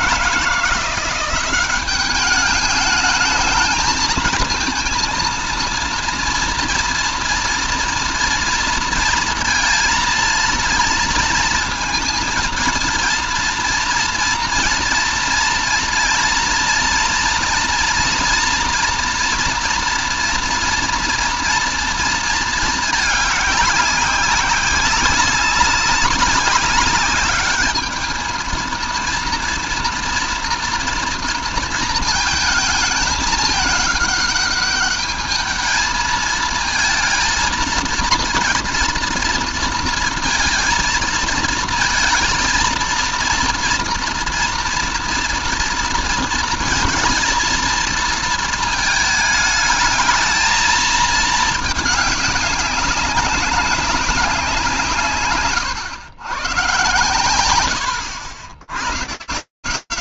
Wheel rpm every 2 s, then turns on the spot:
180, 210, 220, 230, 230, 230, 230, 230, 240, 240, 240, 220, 190, 200, 220, 230, 220, 210, 220, 230, 230, 230, 230, 230, 220, 220, 200, 160, 120, 90.
none